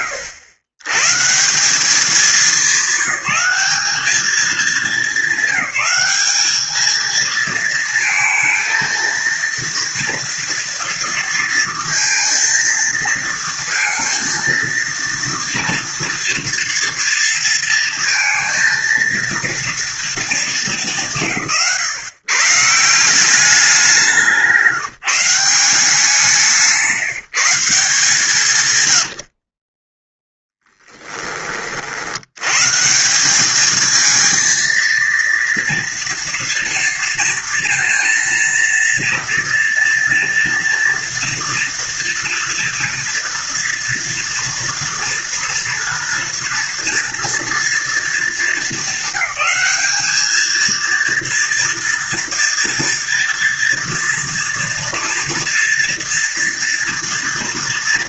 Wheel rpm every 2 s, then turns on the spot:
120, 190, 200, 210, 230, 230, 230, 230, 230, 230, 190, 160, 160, 170, 100, 10, 160, 230, 230, 230, 230, 230, 230, 240, 200, 230, 230, 230, 230.
none